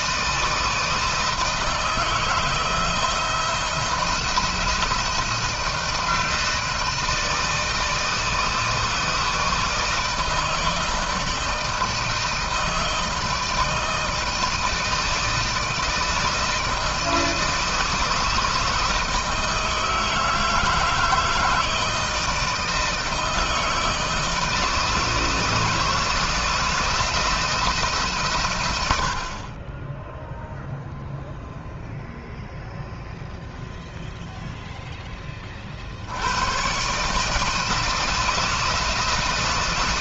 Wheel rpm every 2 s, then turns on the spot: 160, 160, 170, 160, 160, 160, 160, 160, 160, 160, 160, 160, 160, 160, 110, 0, 0, 0, 120, 160.
none